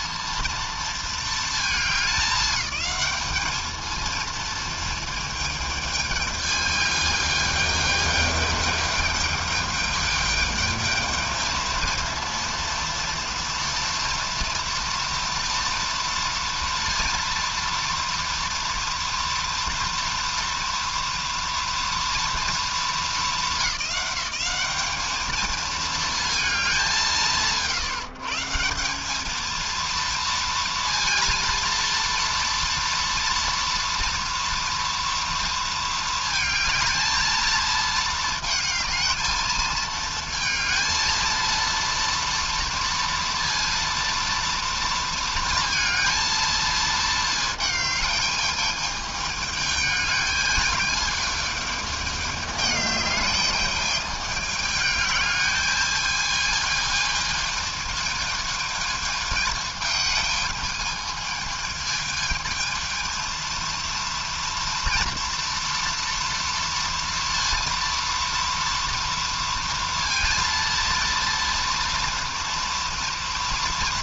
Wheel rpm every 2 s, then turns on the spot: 230, 210, 230, 210, 210, 220, 230, 230, 230, 230, 230, 230, 210, 210, 160, 230, 230, 230, 220, 220, 230, 230, 230, 220, 210, 210, 210, 210, 220, 220, 220, 220, 230, 230, 230, 230, 230.
none